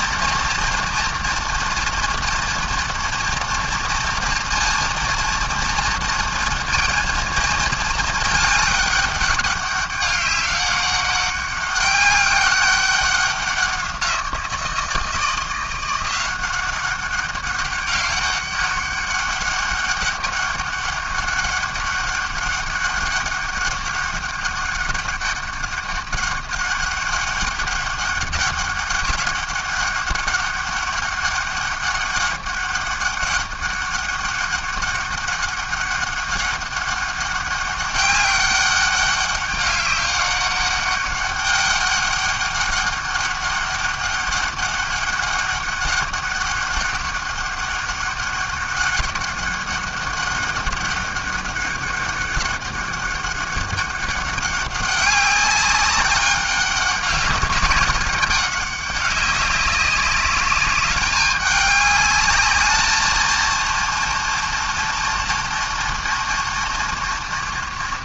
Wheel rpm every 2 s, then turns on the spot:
230, 240, 230, 230, 210, 200, 200, 170, 190, 190, 200, 200, 200, 200, 200, 200, 200, 200, 200, 200, 200, 200, 200, 200, 200, 200, 200, 200, 200, 200, 210, 210, 240, 230.
none